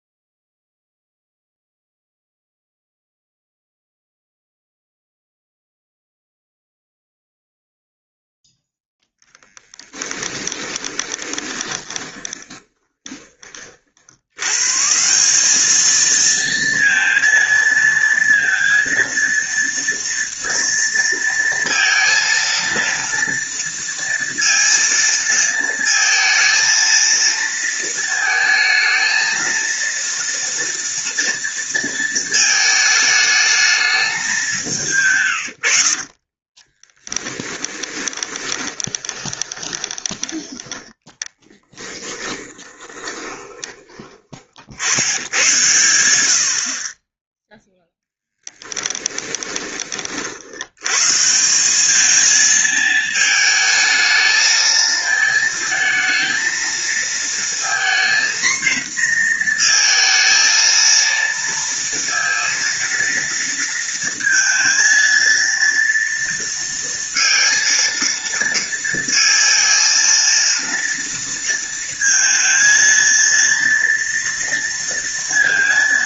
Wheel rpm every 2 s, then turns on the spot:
0, 0, 0, 0, 0, 20, 20, 140, 230, 230, 230, 230, 230, 230, 220, 230, 220, 170, 20, 20, 10, 30, 60, 50, 10, 100, 220, 220, 230, 240, 230, 230, 230, 230, 230, 230, 230, 230.
10-14 34-40 42-44 48-50